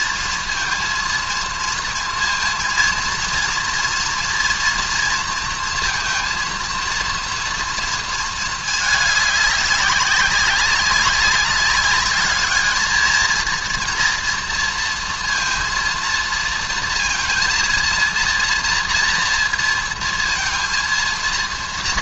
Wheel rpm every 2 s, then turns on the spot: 230, 230, 240, 230, 220, 190, 220, 230, 230, 230, 230.
none